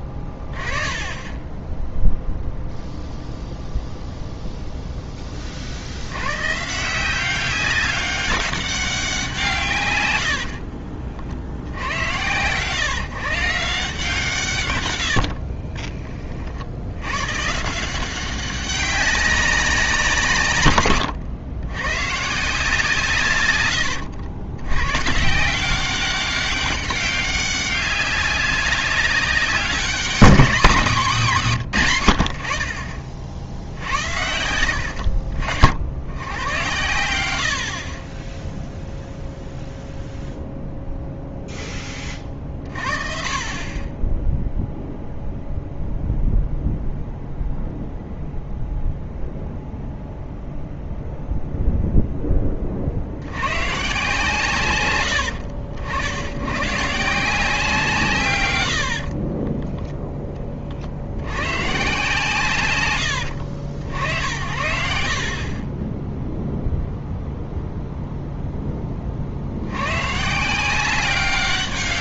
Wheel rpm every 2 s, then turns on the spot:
10, 0, 0, 140, 190, 50, 120, 120, 60, 190, 130, 150, 110, 190, 200, 220, 70, 80, 100, 0, 0, 40, 0, 0, 0, 0, 30, 150, 130, 100, 40, 150, 80, 0, 10, 170.
10-12